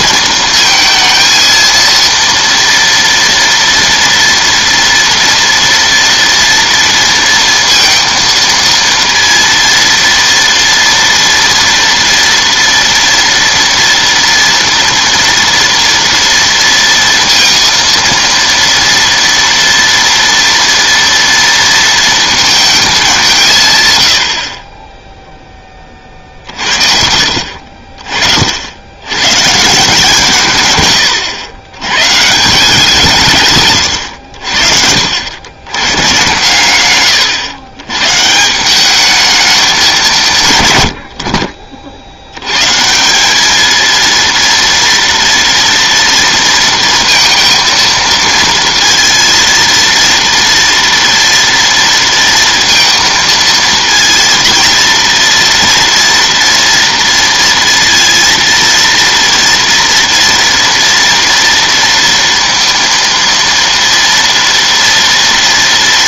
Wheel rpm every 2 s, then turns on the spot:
230, 230, 230, 230, 230, 230, 230, 230, 230, 230, 230, 210, 20, 50, 80, 120, 170, 60, 120, 170, 130, 130, 230, 230, 230, 230, 230, 230, 230, 230, 230, 230, 230.
26-28 30-32